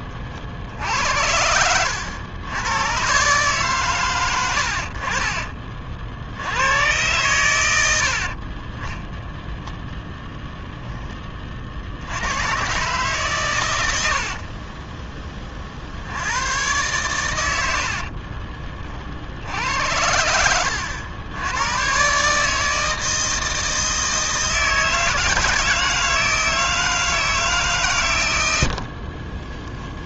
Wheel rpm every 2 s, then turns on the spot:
70, 100, 80, 100, 20, 10, 120, 30, 120, 40, 90, 160, 160, 160, 60.
14-16 28-30